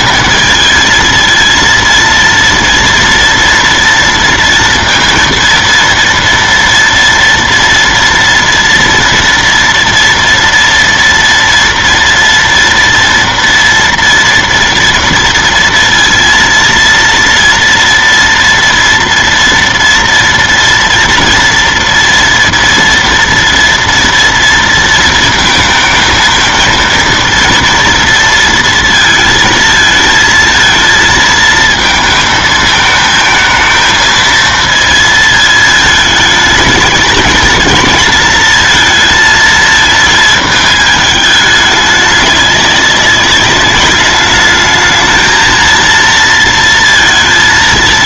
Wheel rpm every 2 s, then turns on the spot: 220, 230, 230, 230, 230, 230, 230, 230, 230, 230, 230, 230, 230, 220, 230, 220, 220, 230, 220, 220, 220, 200, 210, 230.
none